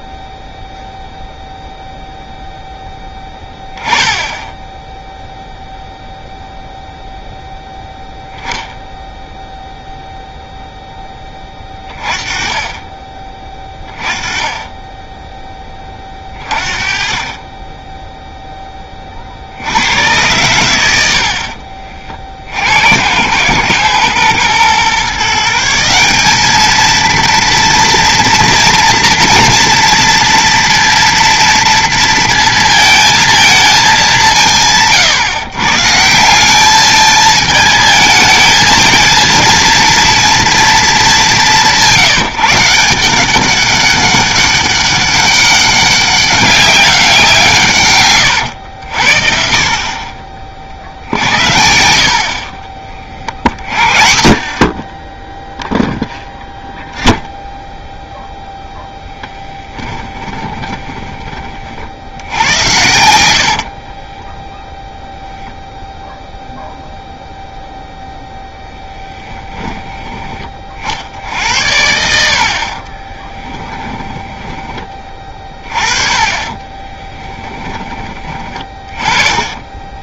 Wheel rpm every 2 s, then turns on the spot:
0, 0, 0, 0, 0, 0, 30, 20, 30, 10, 100, 80, 130, 220, 240, 230, 230, 160, 210, 230, 230, 170, 200, 190, 80, 50, 20, 50, 0, 10, 20, 100, 0, 0, 0, 50, 40, 20, 20, 20.
54-56 60-62 72-74 76-80